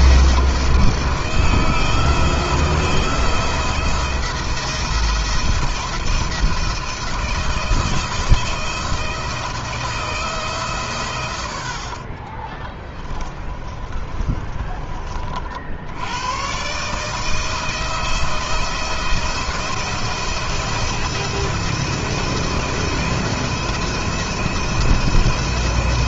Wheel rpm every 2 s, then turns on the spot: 170, 170, 170, 170, 160, 130, 20, 30, 140, 170, 170, 170, 170.
12-14